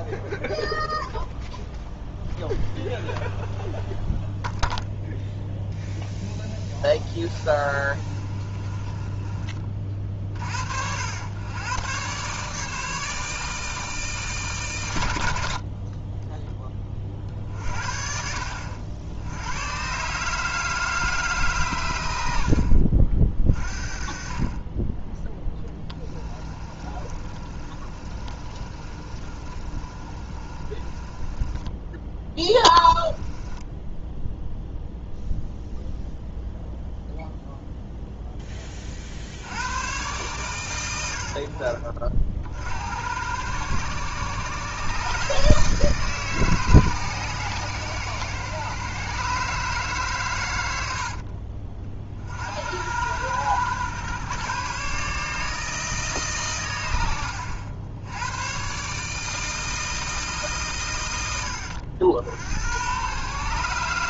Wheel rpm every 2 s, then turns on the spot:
0, 0, 0, 10, 20, 70, 150, 120, 40, 80, 160, 70, 20, 30, 30, 30, 10, 0, 0, 30, 100, 70, 140, 140, 130, 80, 80, 140, 110, 130, 120, 100.
6-10 26-34